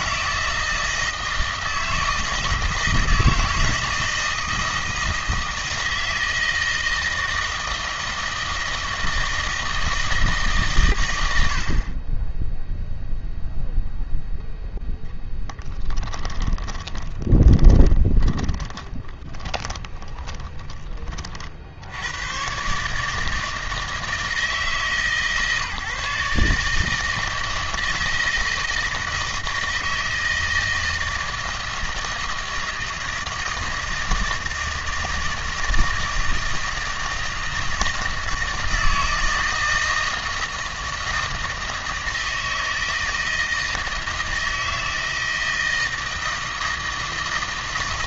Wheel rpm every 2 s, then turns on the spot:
160, 160, 160, 160, 160, 120, 0, 0, 20, 20, 30, 140, 160, 160, 160, 160, 160, 160, 160, 160, 160, 160, 160, 160.
16-22